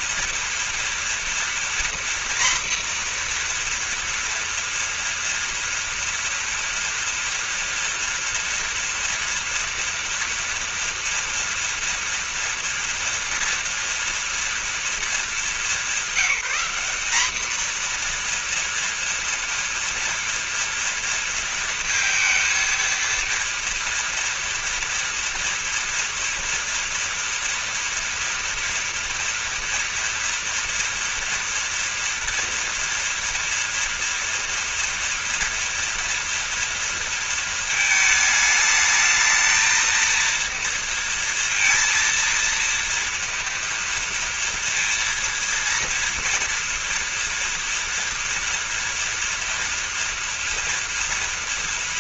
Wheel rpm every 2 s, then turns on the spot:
230, 240, 230, 230, 230, 230, 230, 230, 200, 240, 230, 230, 230, 230, 230, 230, 230, 230, 230, 220, 230, 230, 230, 230, 230, 230.
none